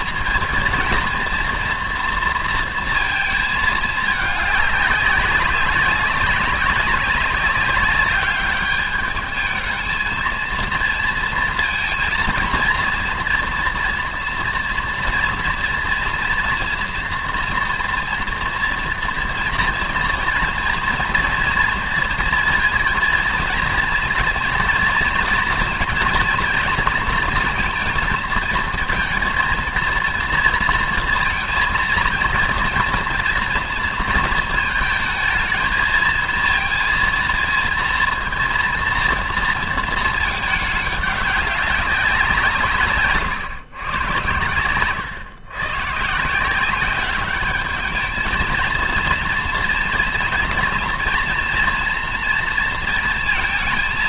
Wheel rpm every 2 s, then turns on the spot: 230, 230, 200, 190, 210, 230, 230, 230, 240, 230, 230, 230, 230, 230, 230, 230, 230, 220, 230, 230, 200, 140, 120, 200, 220, 230, 230.
44-46